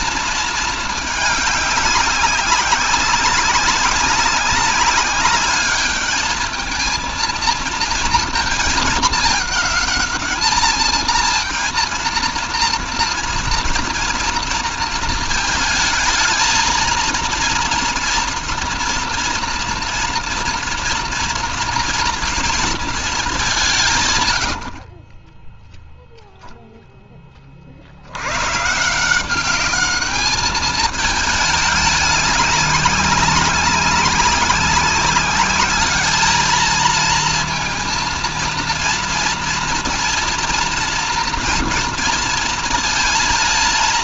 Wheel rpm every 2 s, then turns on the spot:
230, 190, 190, 220, 220, 220, 230, 230, 230, 230, 230, 230, 60, 0, 140, 210, 200, 190, 220, 230, 230, 230.
none